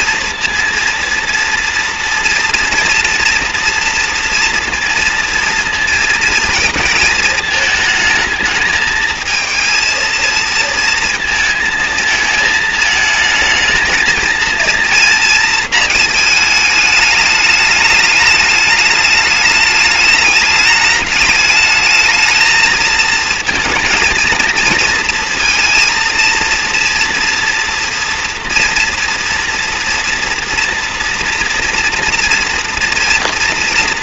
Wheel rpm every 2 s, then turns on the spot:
230, 230, 230, 230, 220, 220, 220, 230, 210, 210, 210, 220, 230, 230, 240, 230, 230.
none